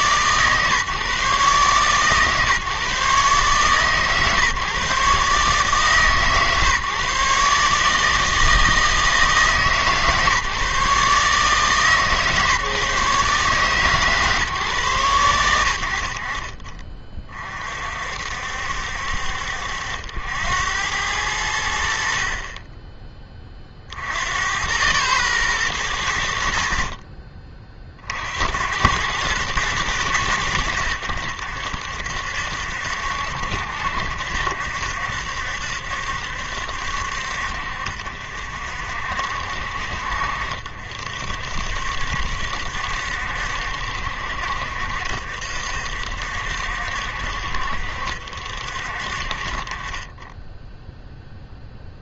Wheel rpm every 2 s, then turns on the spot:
140, 140, 140, 140, 160, 150, 140, 130, 40, 60, 90, 30, 100, 30, 90, 80, 70, 70, 70, 60, 60, 70, 60, 60, 50, 10.
none